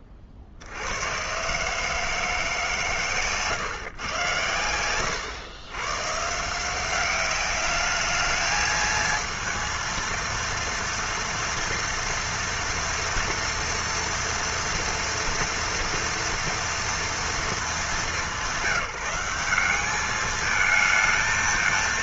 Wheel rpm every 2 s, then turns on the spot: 80, 150, 110, 160, 220, 230, 230, 230, 230, 190, 220.
none